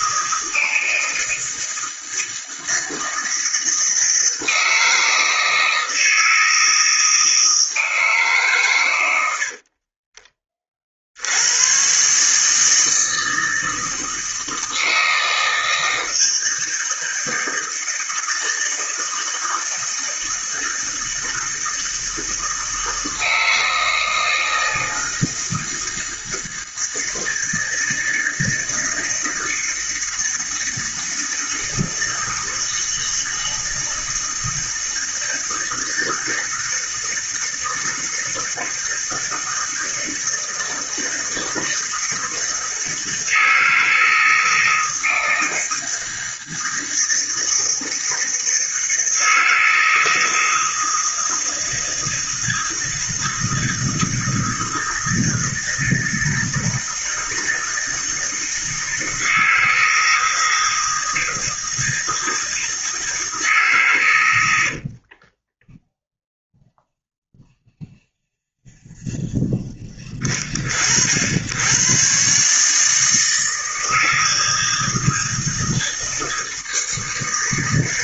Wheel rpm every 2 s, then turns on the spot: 160, 160, 160, 160, 130, 40, 160, 160, 160, 160, 160, 160, 160, 160, 160, 160, 160, 160, 160, 160, 160, 160, 160, 160, 160, 160, 160, 160, 160, 160, 160, 160, 60, 0, 0, 50, 150, 160, 160.
64-66